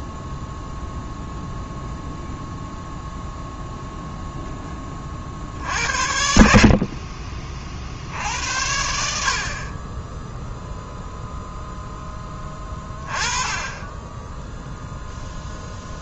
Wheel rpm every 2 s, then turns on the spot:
0, 0, 20, 40, 80, 0, 20, 0.
none